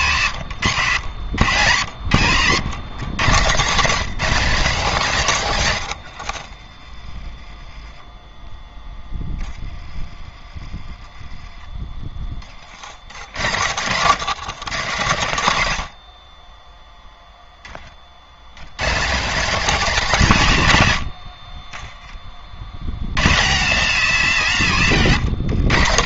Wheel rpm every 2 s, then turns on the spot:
120, 190, 40, 10, 30, 20, 120, 130, 10, 200, 50, 160, 150.
4-6